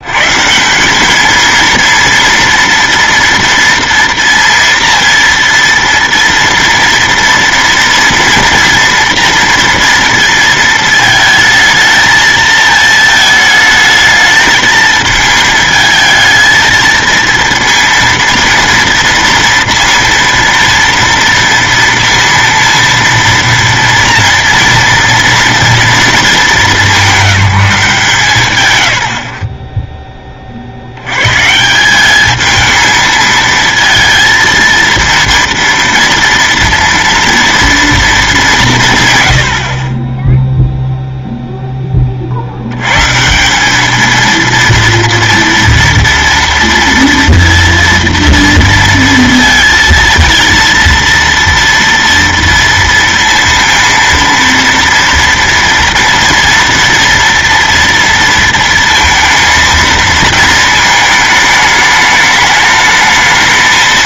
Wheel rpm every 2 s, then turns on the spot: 190, 230, 230, 230, 240, 220, 220, 220, 230, 230, 230, 230, 240, 210, 120, 80, 220, 230, 230, 140, 0, 120, 230, 230, 230, 230, 230, 230, 230, 230, 220, 220.
none